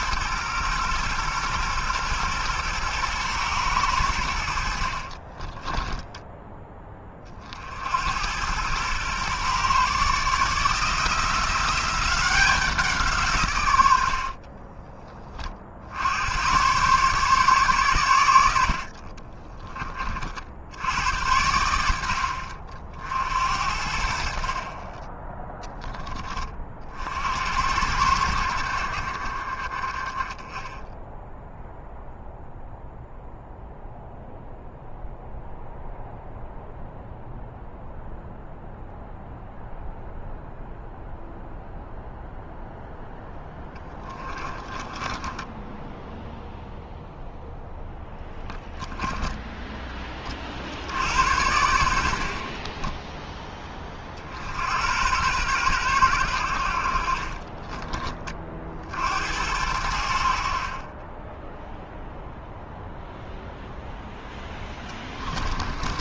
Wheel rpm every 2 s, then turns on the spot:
120, 120, 40, 20, 120, 160, 180, 20, 140, 40, 90, 60, 30, 50, 50, 0, 0, 0, 0, 0, 0, 0, 20, 0, 10, 80, 20, 100, 50, 60, 20, 0, 20.
4-6 44-46 48-50 52-54 64-66